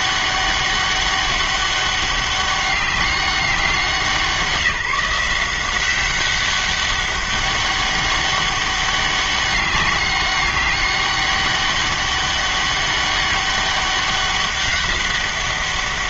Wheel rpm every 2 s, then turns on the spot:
200, 200, 170, 200, 200, 200, 200, 200.
none